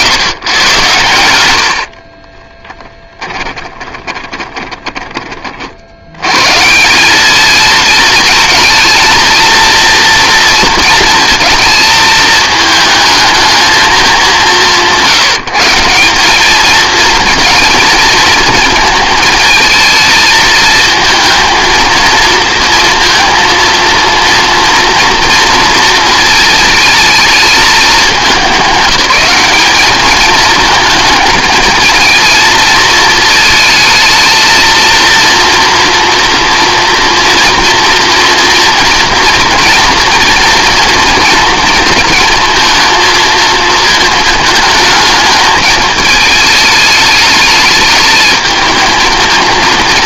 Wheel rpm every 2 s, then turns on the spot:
130, 20, 10, 170, 230, 230, 220, 180, 220, 220, 220, 230, 230, 220, 200, 220, 230, 230, 240, 240, 230, 220, 220, 220, 220.
2-6